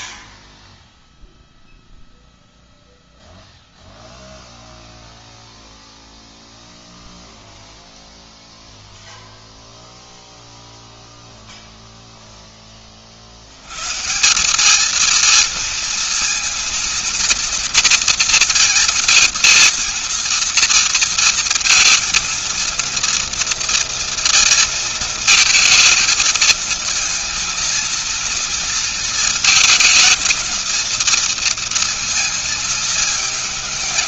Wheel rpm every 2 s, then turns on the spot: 0, 0, 0, 0, 0, 0, 0, 180, 230, 230, 230, 230, 230, 230, 230, 220, 230.
none